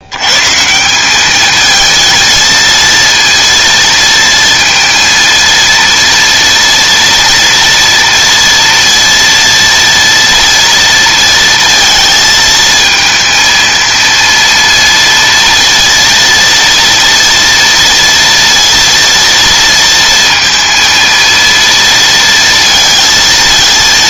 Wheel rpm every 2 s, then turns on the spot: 140, 220, 230, 230, 230, 230, 220, 230, 230, 230, 230, 230.
none